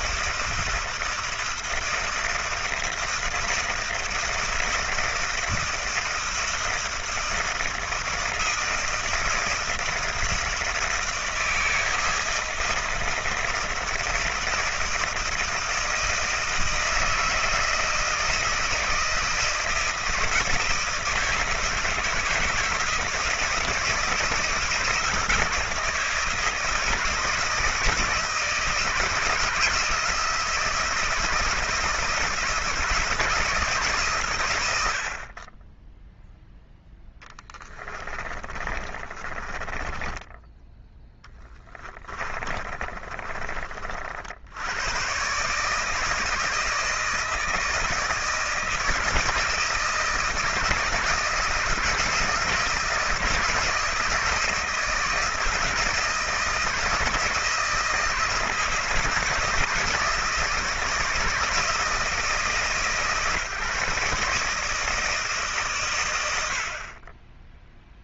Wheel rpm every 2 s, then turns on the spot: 160, 160, 160, 160, 160, 160, 160, 170, 160, 160, 160, 160, 160, 160, 160, 160, 170, 100, 0, 20, 10, 30, 90, 160, 160, 160, 160, 160, 160, 170, 150, 150, 160, 60.
38-40 42-44